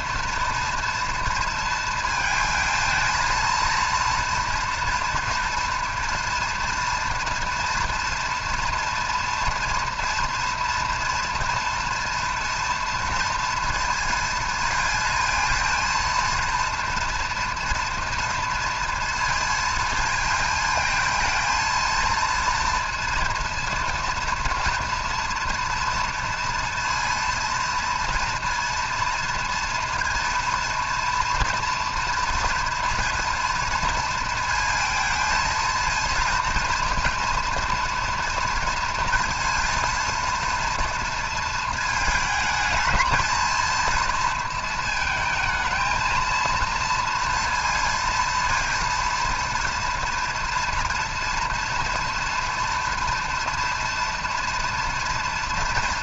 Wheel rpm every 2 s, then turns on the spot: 230, 220, 230, 230, 230, 230, 230, 230, 230, 230, 220, 230, 230, 230, 230, 230, 230, 230, 230, 230, 230, 220, 230, 230, 230, 240, 240, 230.
none